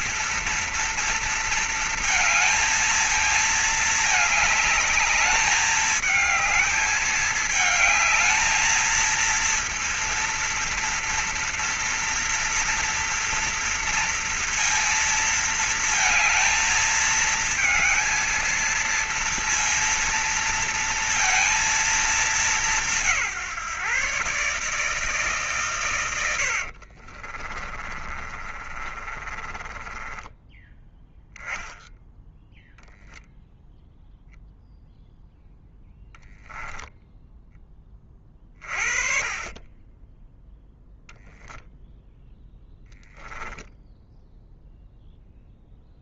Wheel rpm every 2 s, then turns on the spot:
230, 220, 220, 220, 230, 230, 230, 230, 220, 230, 230, 170, 140, 40, 30, 10, 0, 0, 10, 30, 0, 10, 0.
26-30 42-44